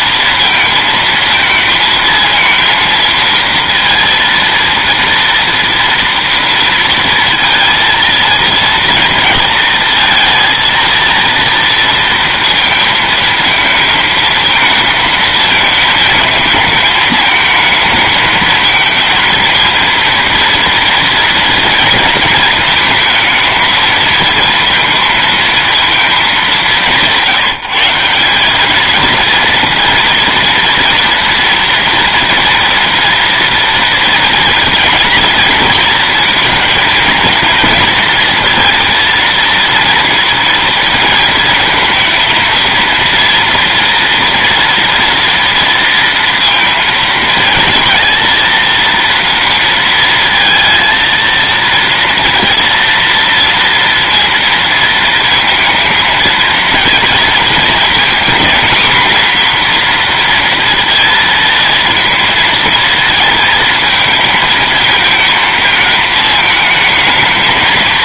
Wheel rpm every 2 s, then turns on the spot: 230, 230, 230, 230, 220, 230, 230, 220, 220, 230, 230, 230, 220, 180, 230, 240, 240, 230, 230, 230, 230, 230, 230, 230, 230, 230, 230, 230, 230, 240, 230, 220, 220, 220.
none